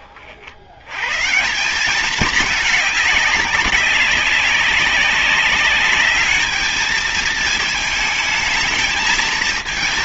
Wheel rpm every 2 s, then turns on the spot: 50, 210, 200, 210, 220.
none